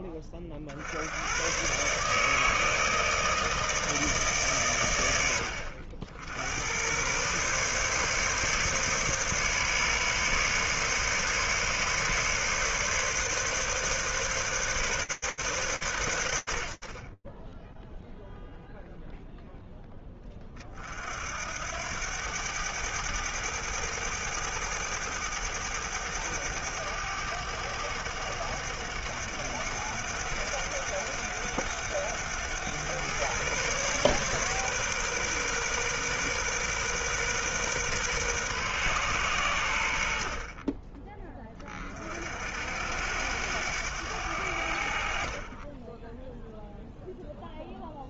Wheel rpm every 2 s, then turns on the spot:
40, 160, 140, 70, 140, 140, 140, 130, 90, 0, 30, 100, 100, 100, 100, 100, 110, 130, 130, 110, 30, 80, 60, 0.
none